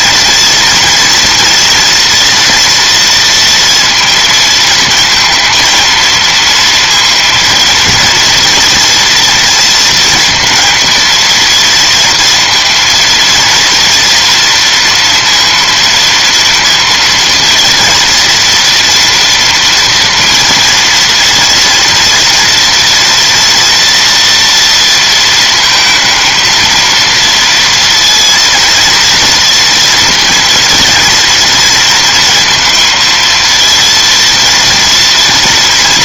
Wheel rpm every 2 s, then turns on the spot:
240, 230, 230, 230, 240, 230, 230, 230, 230, 240, 230, 230, 230, 230, 230, 230, 230, 230.
none